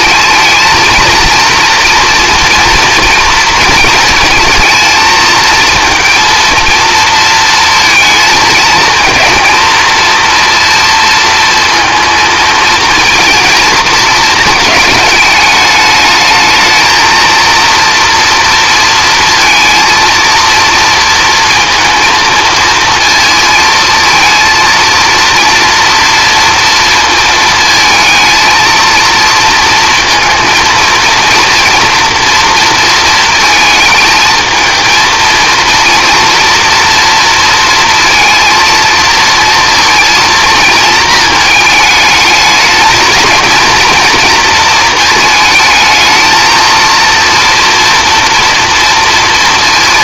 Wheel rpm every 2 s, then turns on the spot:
230, 230, 220, 230, 220, 230, 230, 210, 230, 230, 230, 230, 230, 230, 230, 230, 230, 230, 230, 230, 220, 220, 220, 230, 230.
none